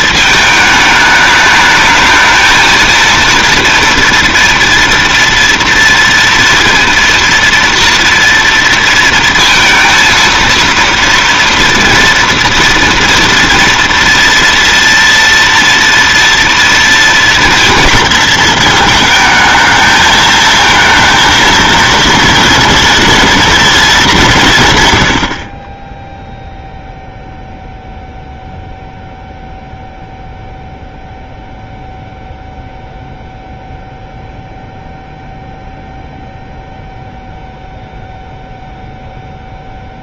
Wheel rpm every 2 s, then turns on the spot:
220, 220, 230, 230, 230, 230, 240, 230, 230, 220, 220, 230, 170, 0, 0, 0, 0, 0, 0, 0.
none